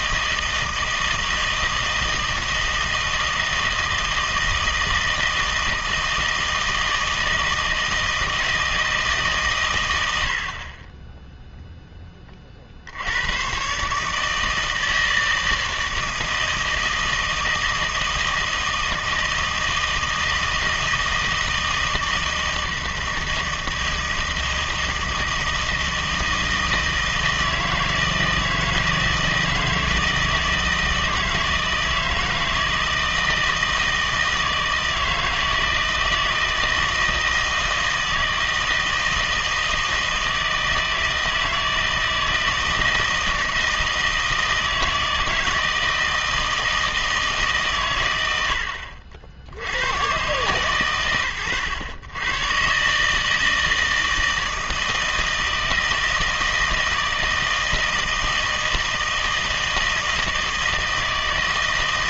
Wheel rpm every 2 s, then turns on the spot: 160, 160, 160, 160, 160, 40, 50, 160, 160, 160, 160, 160, 160, 160, 160, 160, 160, 160, 160, 160, 160, 160, 160, 160, 80, 130, 130, 160, 160, 160, 160.
none